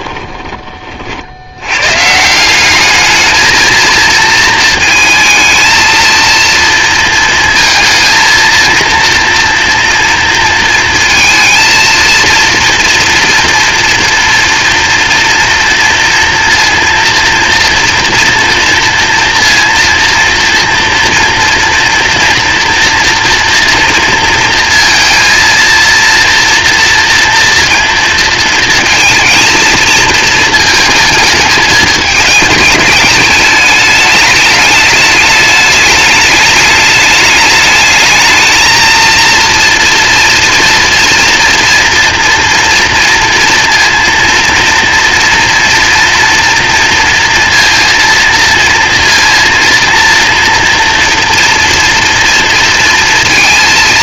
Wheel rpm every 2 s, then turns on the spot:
40, 210, 220, 230, 230, 220, 230, 230, 230, 230, 230, 230, 230, 230, 220, 220, 210, 210, 210, 230, 230, 230, 230, 230, 230, 240, 230.
none